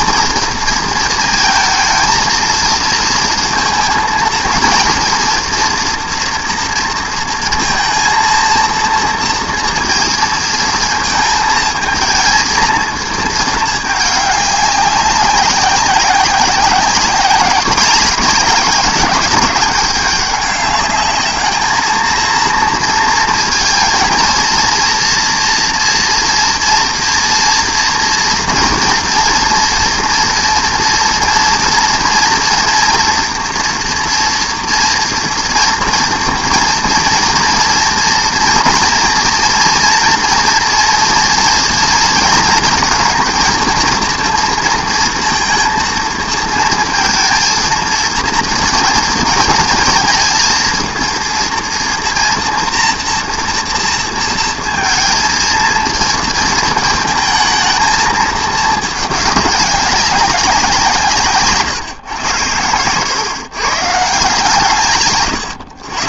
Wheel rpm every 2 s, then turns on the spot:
230, 230, 230, 240, 230, 220, 220, 200, 190, 200, 200, 230, 230, 230, 230, 230, 230, 240, 230, 230, 230, 230, 230, 230, 230, 230, 230, 230, 230, 210, 190, 100, 150.
62-64